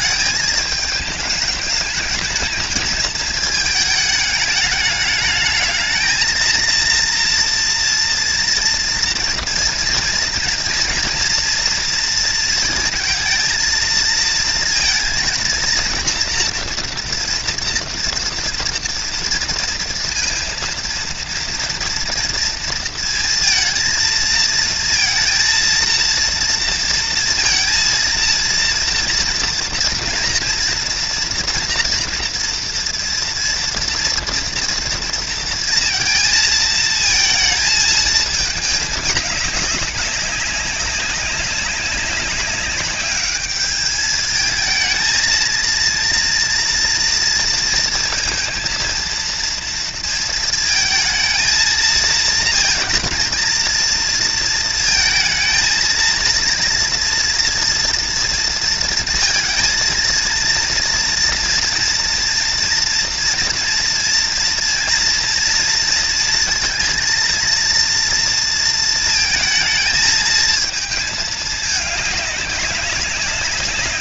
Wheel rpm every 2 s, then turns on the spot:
210, 220, 210, 230, 230, 230, 230, 230, 230, 230, 230, 230, 230, 230, 230, 230, 240, 230, 230, 210, 190, 200, 220, 230, 230, 220, 230, 230, 230, 230, 230, 230, 230, 230, 230, 220, 190.
none